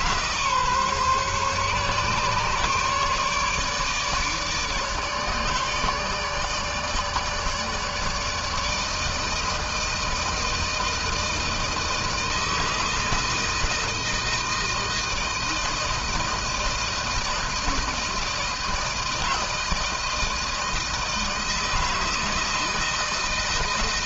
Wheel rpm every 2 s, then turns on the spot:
140, 150, 150, 150, 160, 160, 160, 160, 160, 160, 160, 160.
none